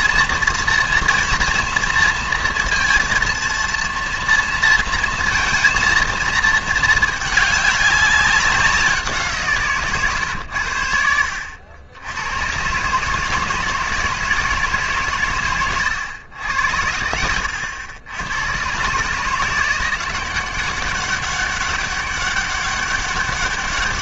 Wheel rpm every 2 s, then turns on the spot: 230, 230, 230, 220, 190, 100, 120, 150, 90, 110, 190, 200.
none